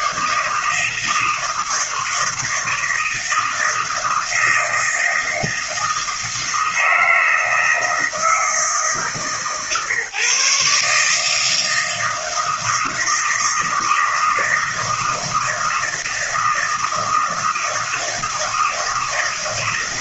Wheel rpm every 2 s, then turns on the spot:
160, 160, 160, 160, 160, 140, 160, 160, 160, 160.
none